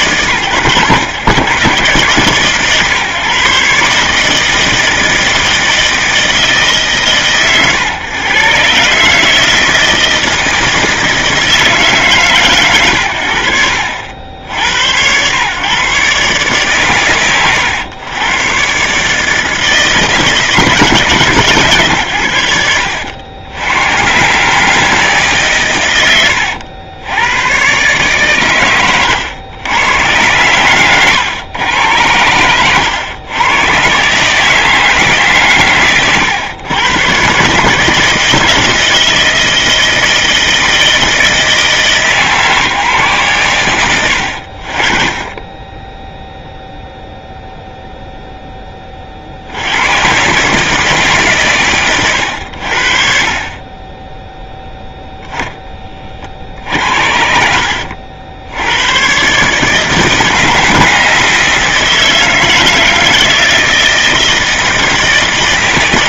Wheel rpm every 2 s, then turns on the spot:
120, 140, 160, 140, 140, 160, 110, 100, 130, 140, 150, 90, 150, 100, 110, 110, 110, 160, 110, 160, 160, 130, 30, 0, 30, 160, 40, 10, 60, 100, 160, 160, 160.
30-32 56-58